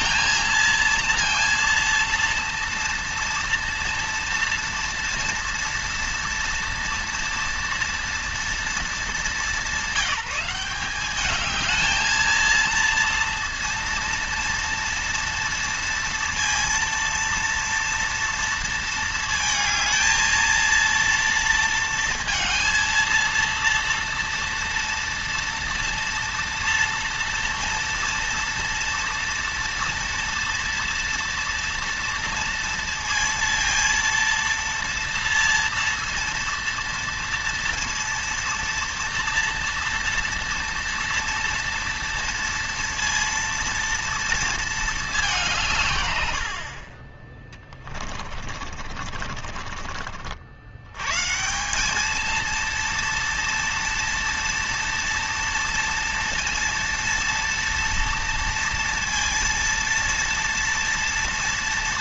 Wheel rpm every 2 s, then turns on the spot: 230, 230, 230, 230, 210, 190, 230, 230, 230, 230, 230, 230, 230, 230, 230, 230, 230, 230, 230, 230, 230, 230, 230, 70, 50, 90, 230, 230, 230, 230, 230.
48-50